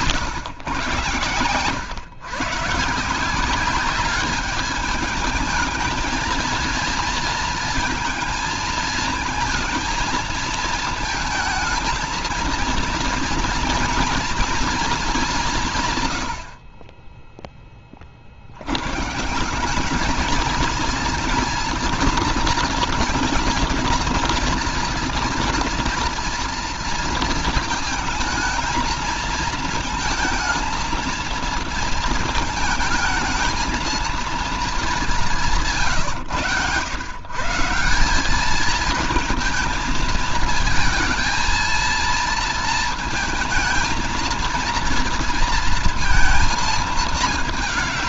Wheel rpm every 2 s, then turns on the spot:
140, 140, 210, 230, 230, 220, 230, 230, 60, 100, 220, 240, 230, 230, 220, 230, 220, 230, 120, 210, 220, 230, 230, 230.
none